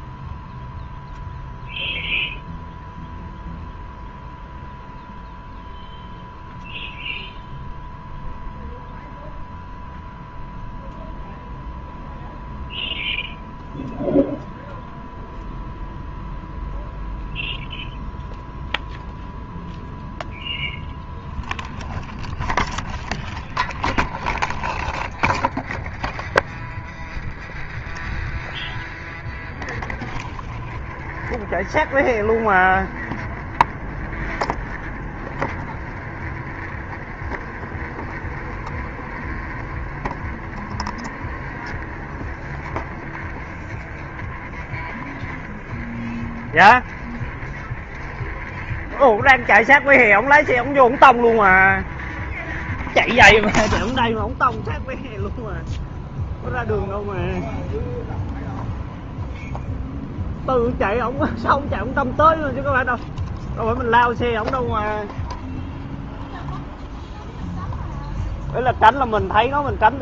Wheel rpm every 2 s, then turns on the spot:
0, 0, 0, 0, 0, 0, 0, 0, 0, 0, 0, 0, 0, 0, 0, 0, 0, 0, 0, 0, 0, 0, 0, 0, 0, 0, 0, 0, 0, 0, 0, 0, 0, 0, 0.
none